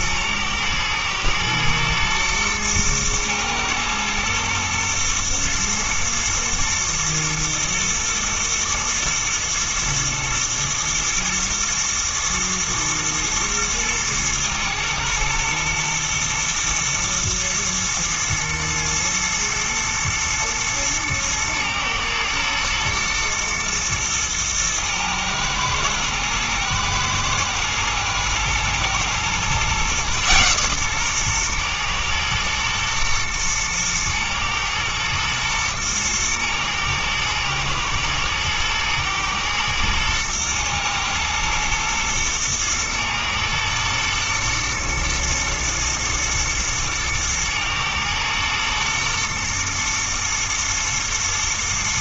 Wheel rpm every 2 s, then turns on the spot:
110, 120, 120, 110, 110, 110, 120, 110, 110, 120, 110, 120, 110, 110, 110, 130, 110, 110, 110, 110, 110, 120, 120, 110, 120, 110.
none